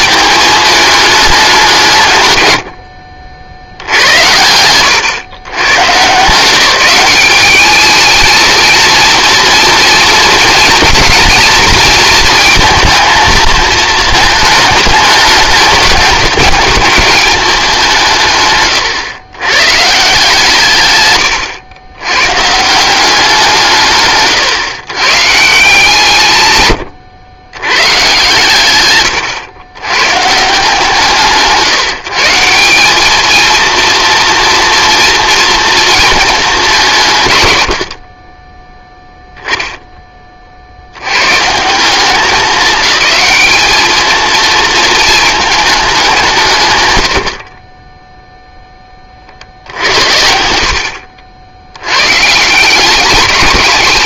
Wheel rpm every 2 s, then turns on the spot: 210, 90, 100, 170, 220, 220, 230, 210, 210, 140, 140, 150, 120, 110, 120, 150, 190, 240, 190, 10, 60, 190, 230, 120, 10, 70, 190.
none